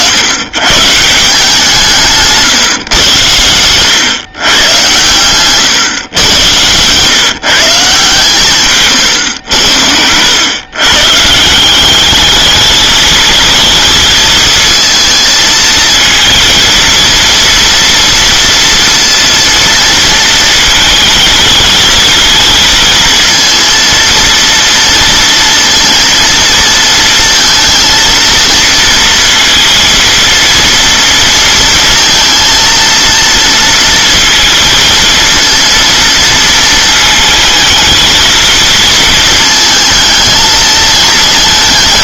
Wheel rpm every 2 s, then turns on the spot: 140, 120, 120, 120, 130, 130, 220, 230, 230, 230, 220, 230, 230, 230, 230, 230, 230, 230, 220, 220, 220.
none